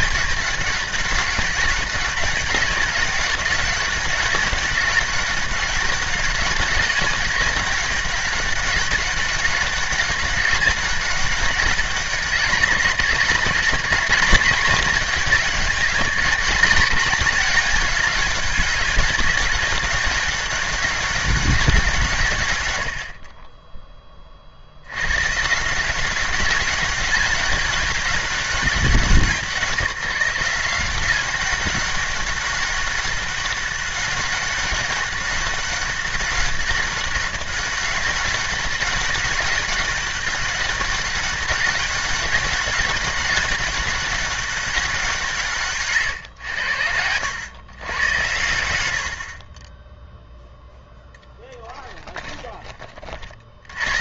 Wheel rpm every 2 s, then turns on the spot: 190, 200, 200, 200, 200, 200, 190, 210, 210, 200, 200, 100, 60, 200, 190, 180, 200, 200, 200, 200, 200, 200, 190, 100, 90, 0, 20.
none